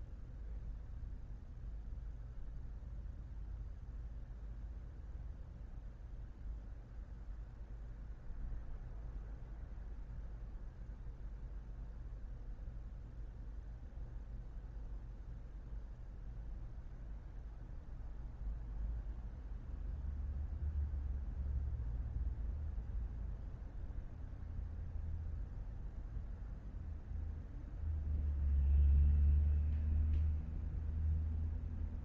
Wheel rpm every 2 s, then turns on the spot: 0, 0, 0, 0, 0, 0, 0, 0, 0, 0, 0, 0, 0, 0, 0, 0.
none